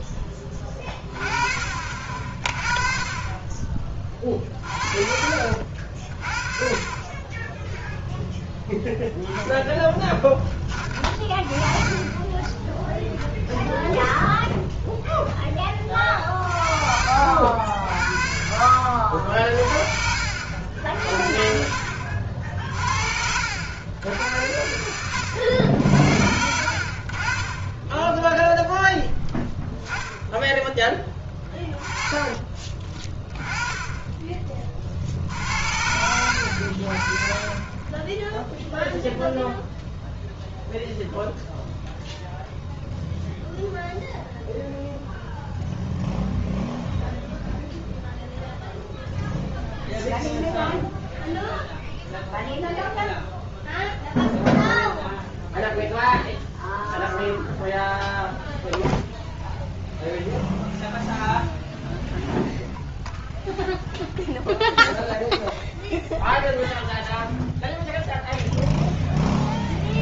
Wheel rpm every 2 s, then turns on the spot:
40, 30, 50, 10, 0, 20, 20, 10, 60, 60, 50, 60, 90, 40, 0, 10, 10, 80, 30, 0, 0, 0, 0, 0, 0, 0, 0, 0, 0, 0, 0, 0, 0, 0, 0.
18-20 22-26 30-32